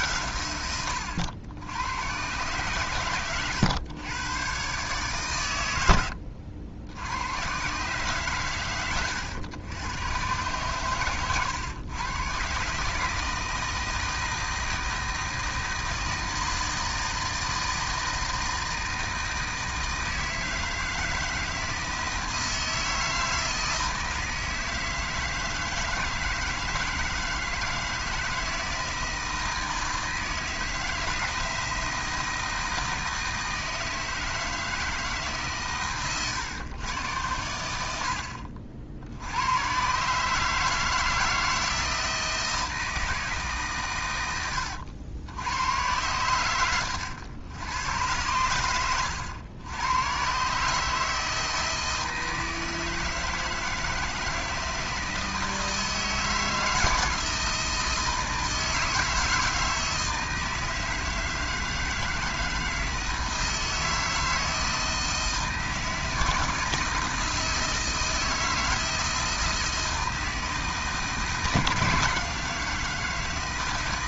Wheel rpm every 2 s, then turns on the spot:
100, 120, 130, 90, 110, 120, 150, 160, 160, 160, 160, 160, 160, 160, 160, 160, 160, 160, 110, 70, 160, 160, 80, 100, 90, 150, 160, 160, 160, 160, 160, 160, 160, 160, 160, 160, 160.
none